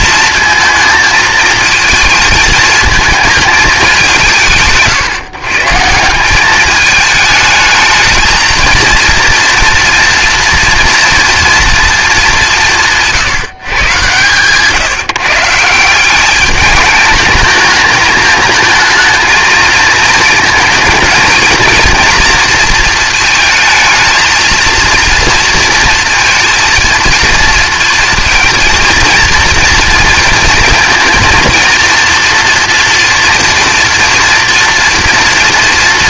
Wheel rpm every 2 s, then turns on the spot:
220, 220, 150, 210, 230, 230, 190, 140, 210, 220, 220, 230, 230, 230, 230, 230, 240, 230.
none